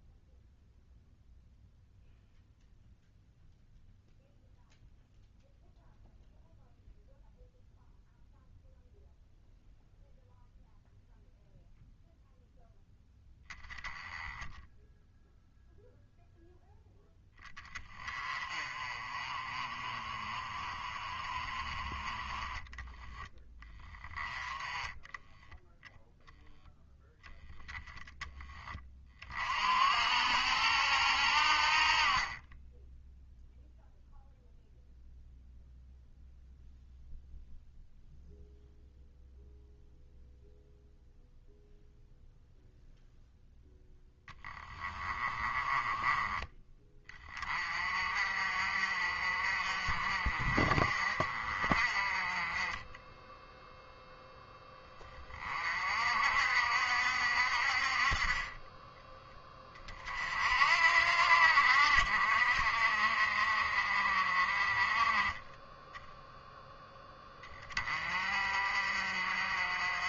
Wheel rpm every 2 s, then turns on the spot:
0, 0, 0, 0, 0, 0, 0, 0, 10, 30, 30, 10, 10, 0, 30, 90, 10, 0, 0, 0, 0, 0, 20, 20, 50, 40, 20, 20, 60, 10, 60, 50, 30, 10, 50.
44-46 58-60